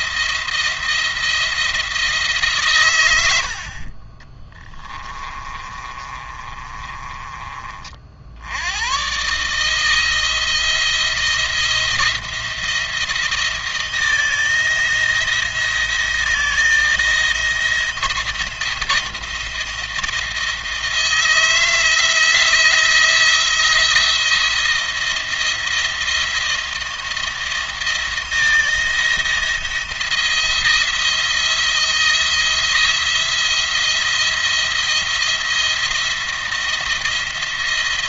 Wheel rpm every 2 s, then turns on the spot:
170, 150, 20, 30, 90, 170, 170, 160, 160, 170, 160, 160, 170, 170, 170, 170, 170, 170, 170.
4-8